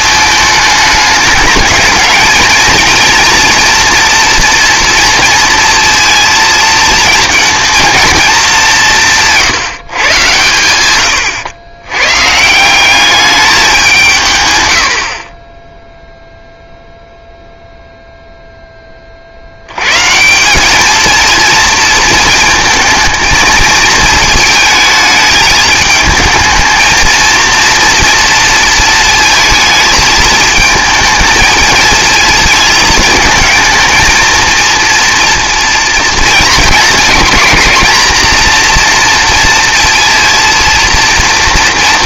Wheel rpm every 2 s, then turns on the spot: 210, 230, 230, 230, 190, 110, 180, 110, 0, 10, 200, 220, 220, 220, 220, 220, 220, 230, 220, 240, 230.
none